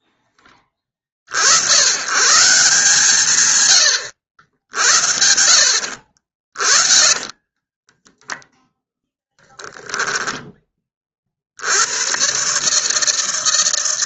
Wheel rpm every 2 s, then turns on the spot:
50, 140, 80, 30, 0, 30, 160.
6-8